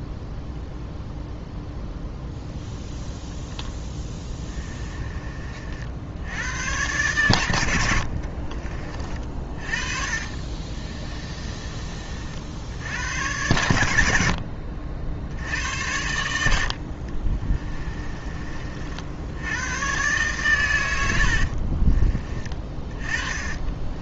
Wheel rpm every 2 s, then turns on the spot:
0, 0, 20, 100, 40, 30, 70, 60, 70, 40, 120, 20.
4-6 8-12 22-24